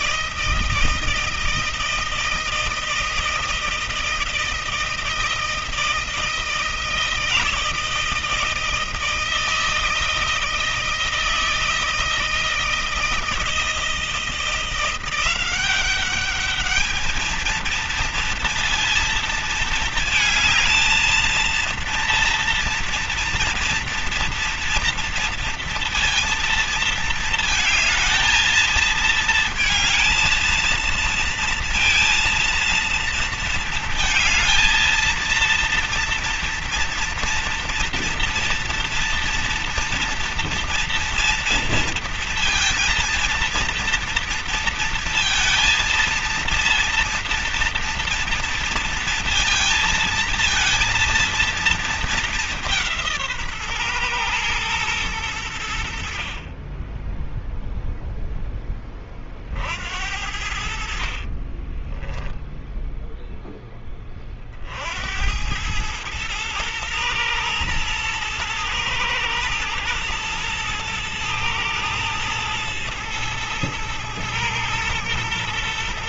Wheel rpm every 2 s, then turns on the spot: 160, 160, 160, 160, 160, 160, 160, 170, 210, 230, 230, 230, 230, 230, 220, 230, 230, 230, 230, 230, 230, 230, 230, 230, 230, 230, 180, 110, 20, 20, 70, 0, 70, 110, 110, 110, 110, 120.
60-62